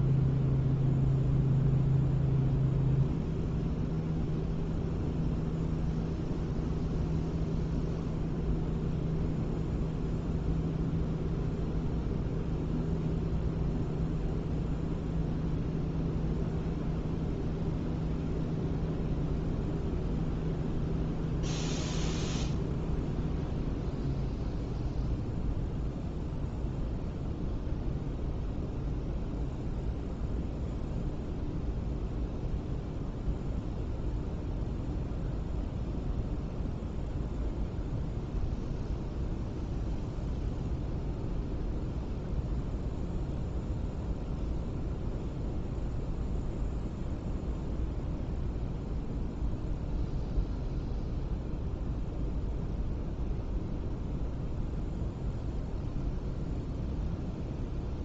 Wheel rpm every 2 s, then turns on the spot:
0, 0, 0, 0, 0, 0, 0, 0, 0, 0, 0, 0, 0, 0, 0, 0, 0, 0, 0, 0, 0, 0, 0, 0, 0, 0, 0, 0, 0.
none